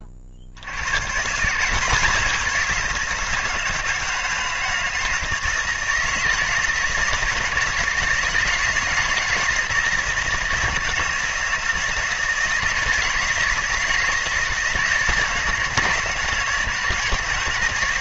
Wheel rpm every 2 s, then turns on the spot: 80, 170, 160, 160, 160, 160, 160, 160, 160.
none